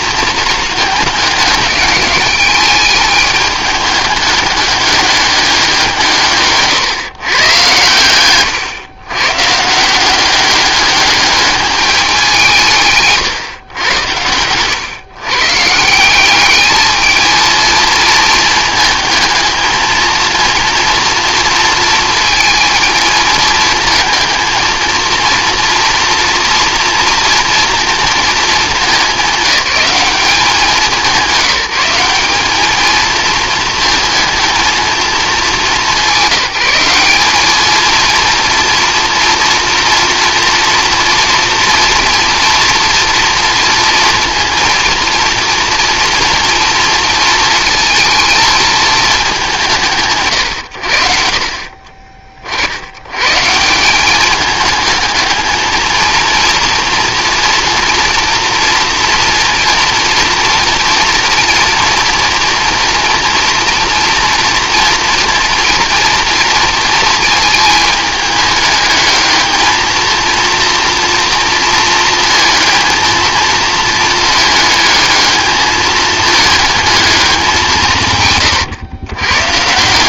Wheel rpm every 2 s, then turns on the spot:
220, 210, 200, 140, 120, 200, 150, 110, 220, 220, 230, 230, 230, 240, 200, 190, 210, 220, 190, 230, 230, 230, 230, 230, 230, 100, 80, 220, 230, 230, 230, 230, 230, 230, 210, 230, 220, 220, 220, 110.
none